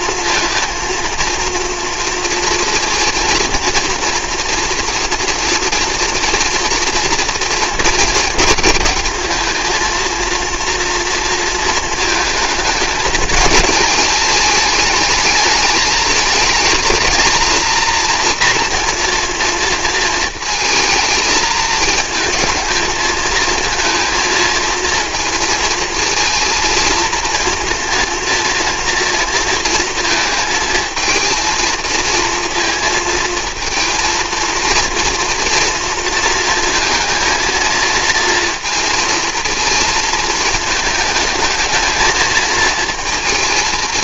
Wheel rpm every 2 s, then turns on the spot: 230, 240, 240, 230, 210, 230, 220, 210, 220, 230, 220, 210, 220, 230, 230, 220, 220, 230, 230, 230, 220, 230.
none